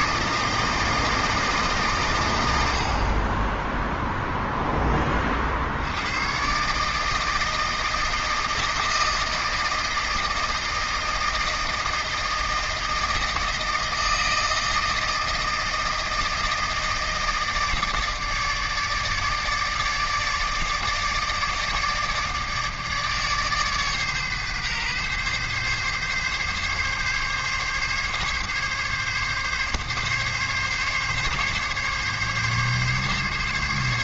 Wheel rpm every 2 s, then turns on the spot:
160, 60, 20, 150, 160, 160, 160, 160, 160, 150, 160, 150, 130, 140, 140, 140, 140.
none